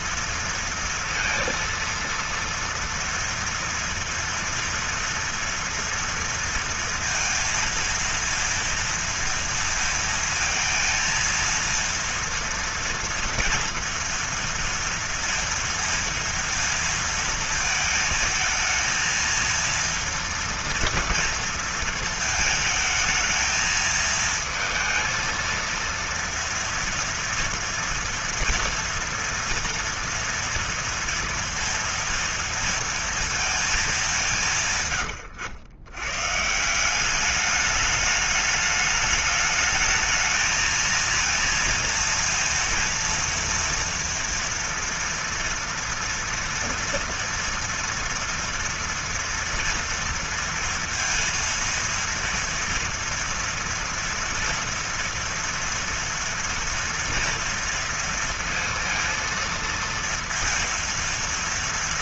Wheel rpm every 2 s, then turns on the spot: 230, 230, 230, 230, 230, 230, 230, 230, 230, 220, 240, 220, 220, 230, 230, 230, 230, 150, 180, 210, 230, 230, 230, 230, 230, 230, 230, 240, 240, 230, 230.
34-36